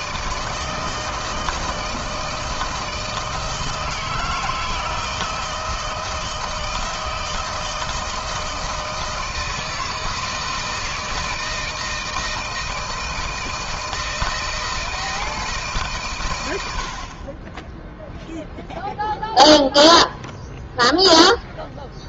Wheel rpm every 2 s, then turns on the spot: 160, 160, 160, 160, 160, 160, 160, 170, 120, 0, 0.
none